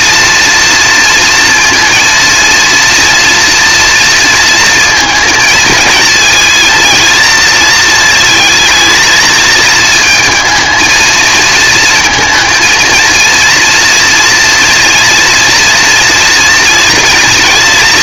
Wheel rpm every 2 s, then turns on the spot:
230, 230, 230, 230, 220, 220, 230, 230, 230.
none